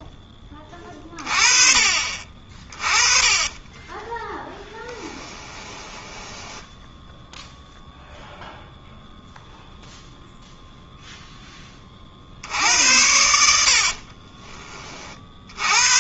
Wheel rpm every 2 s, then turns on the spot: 20, 40, 10, 10, 0, 0, 70, 30.
2-8 14-16